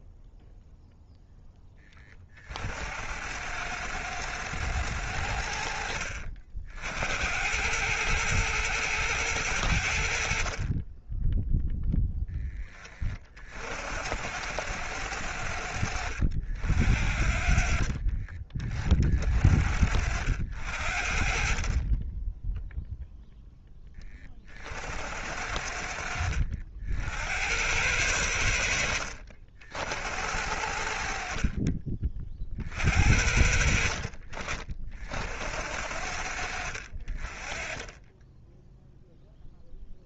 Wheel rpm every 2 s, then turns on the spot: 0, 90, 100, 80, 110, 20, 30, 110, 80, 40, 80, 0, 80, 80, 60, 70, 40, 50, 50, 0.
none